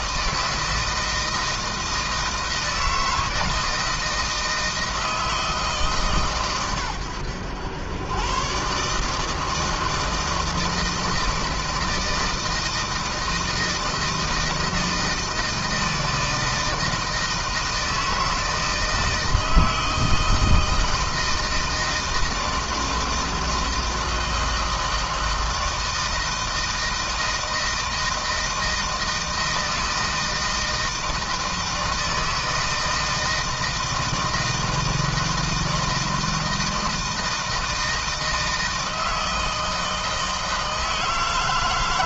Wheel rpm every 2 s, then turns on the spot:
160, 160, 160, 110, 140, 160, 160, 160, 160, 160, 160, 160, 160, 160, 160, 160, 160, 160, 160, 160, 160.
none